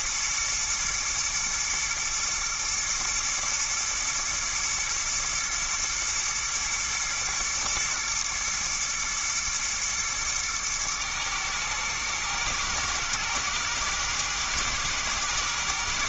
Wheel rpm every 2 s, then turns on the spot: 120, 120, 120, 110, 120, 110, 110, 110.
none